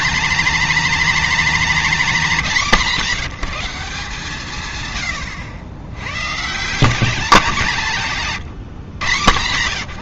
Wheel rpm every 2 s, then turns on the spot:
240, 200, 130, 170, 140.
none